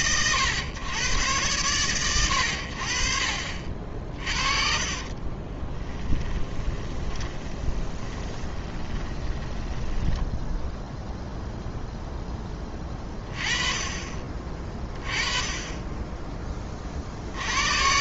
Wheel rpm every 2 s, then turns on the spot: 110, 50, 50, 20, 20, 0, 10, 30, 30.
4-10